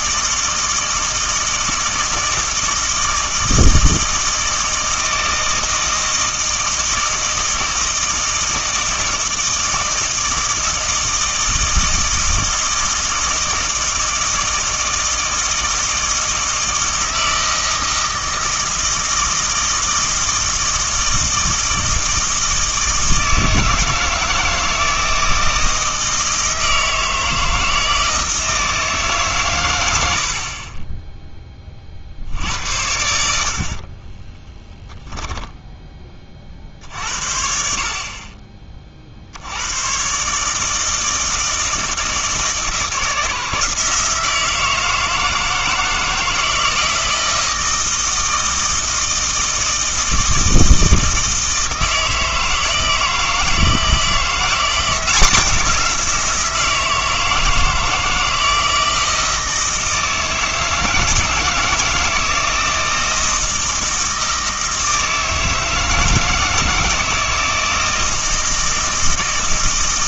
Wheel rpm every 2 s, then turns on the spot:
160, 160, 160, 160, 160, 160, 160, 160, 160, 160, 160, 160, 160, 160, 160, 20, 80, 10, 50, 40, 160, 160, 160, 160, 160, 160, 160, 180, 170, 160, 160, 170, 160, 160, 160.
30-32 34-36